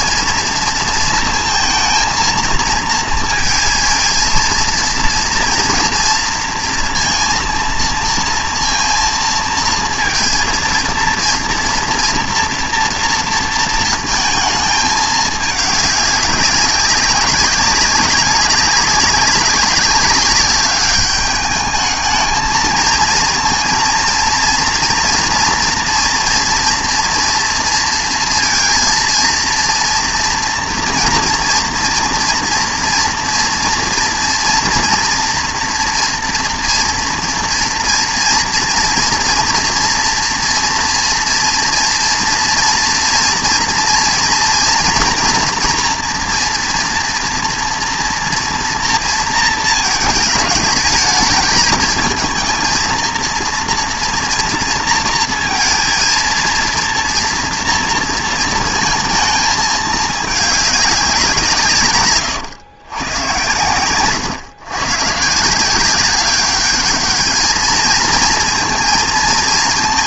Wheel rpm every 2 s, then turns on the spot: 230, 230, 230, 230, 230, 230, 230, 220, 200, 190, 200, 220, 230, 230, 230, 230, 240, 240, 230, 230, 230, 230, 230, 230, 230, 210, 220, 240, 230, 230, 210, 130, 130, 200, 230.
none